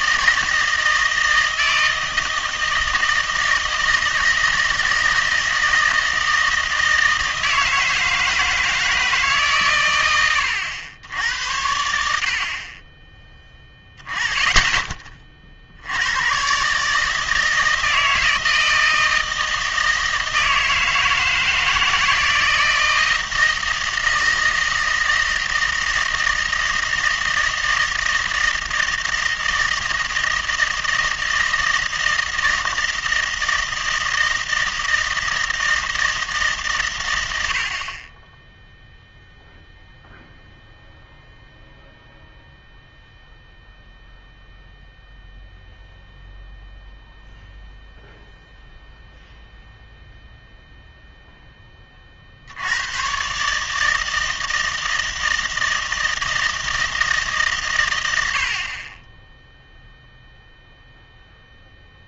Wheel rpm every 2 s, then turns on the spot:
160, 160, 160, 160, 160, 100, 30, 20, 140, 160, 160, 160, 160, 160, 160, 160, 160, 160, 140, 0, 0, 0, 0, 0, 0, 0, 80, 160, 160, 40, 0.
none